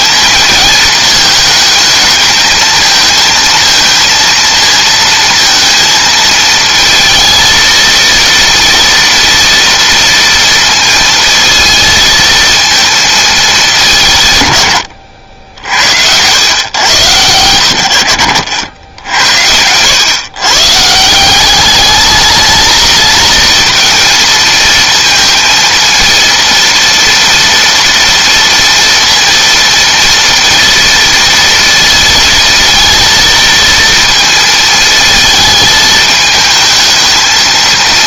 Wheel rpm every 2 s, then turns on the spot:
220, 220, 230, 230, 230, 230, 230, 110, 110, 70, 150, 220, 230, 230, 230, 230, 230, 220, 220.
none